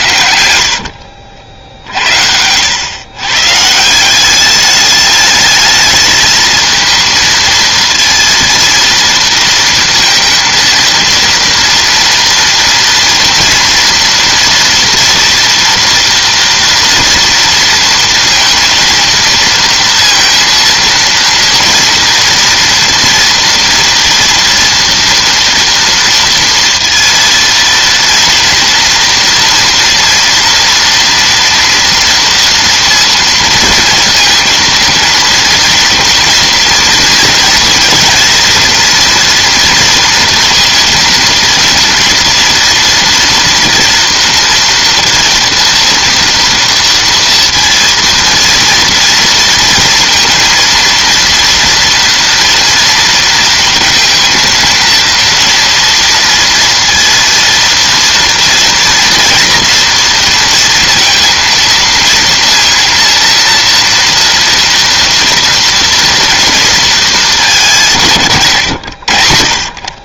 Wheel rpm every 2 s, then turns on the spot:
90, 70, 200, 220, 230, 230, 230, 230, 230, 230, 230, 240, 230, 230, 230, 230, 230, 230, 230, 240, 230, 230, 240, 230, 230, 230, 230, 230, 230, 230, 230, 230, 230, 230, 130.
0-2